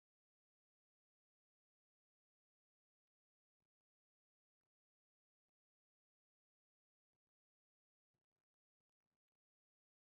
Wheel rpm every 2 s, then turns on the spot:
0, 0, 0, 0, 0.
none